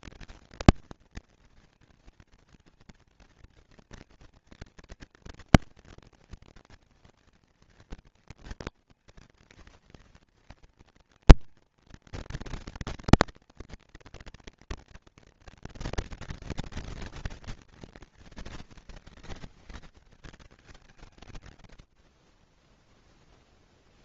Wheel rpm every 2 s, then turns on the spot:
230, 230, 230, 230, 240, 240, 230, 230, 240, 130, 140, 0.
none